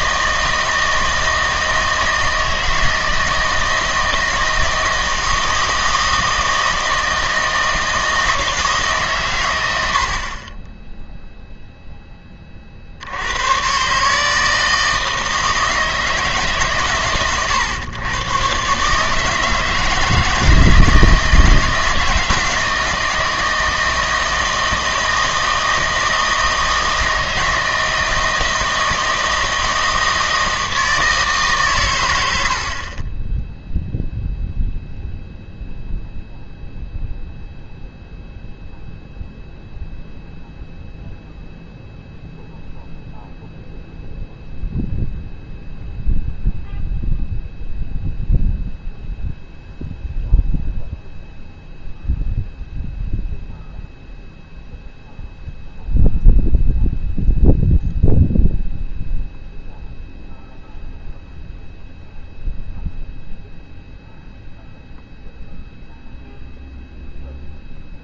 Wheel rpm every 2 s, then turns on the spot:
160, 160, 160, 160, 150, 10, 40, 160, 140, 140, 160, 160, 160, 160, 160, 160, 60, 0, 0, 0, 0, 0, 0, 0, 0, 0, 0, 0, 0, 0, 0, 0, 0, 0.
none